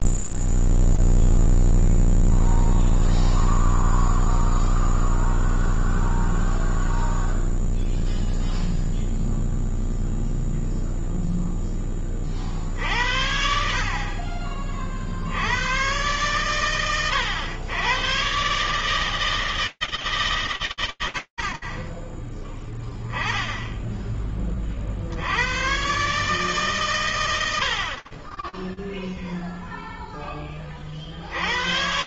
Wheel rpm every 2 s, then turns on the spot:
0, 0, 0, 0, 0, 0, 10, 70, 80, 110, 140, 10, 40, 140, 10, 50.
none